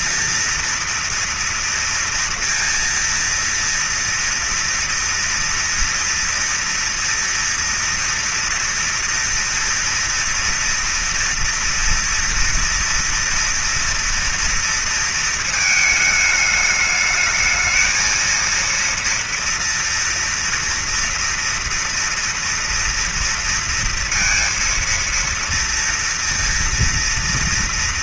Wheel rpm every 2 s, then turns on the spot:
230, 230, 230, 230, 230, 230, 230, 230, 210, 230, 230, 230, 230, 230.
none